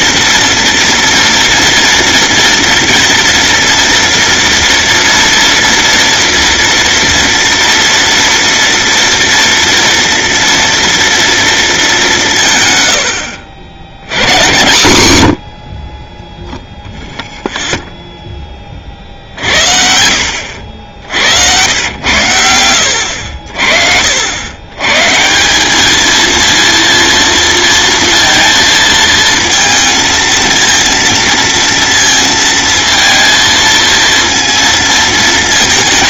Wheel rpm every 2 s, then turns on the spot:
230, 230, 240, 230, 230, 230, 90, 120, 0, 50, 70, 70, 140, 230, 230, 230, 230, 230.
12-14 20-22